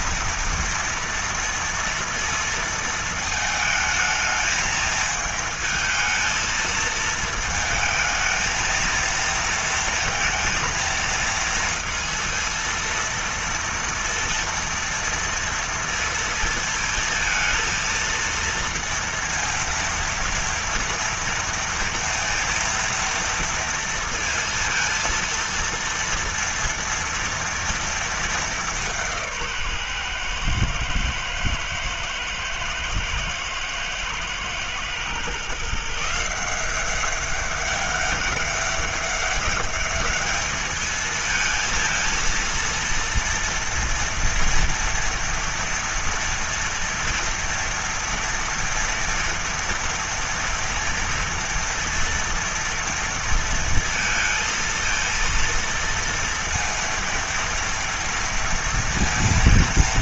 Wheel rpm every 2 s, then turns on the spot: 240, 230, 220, 220, 220, 230, 230, 230, 230, 230, 230, 230, 230, 230, 210, 120, 110, 110, 170, 200, 210, 230, 230, 230, 240, 240, 230, 230, 230, 230.
none